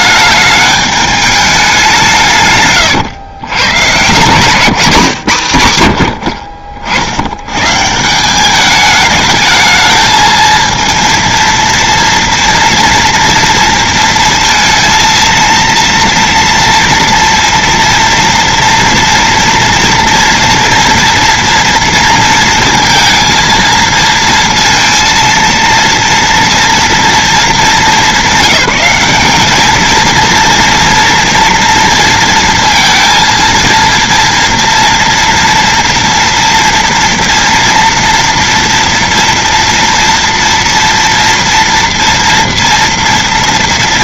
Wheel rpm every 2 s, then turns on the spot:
210, 170, 130, 90, 150, 220, 230, 230, 230, 230, 230, 230, 230, 230, 210, 220, 230, 230, 240, 230, 230, 230.
none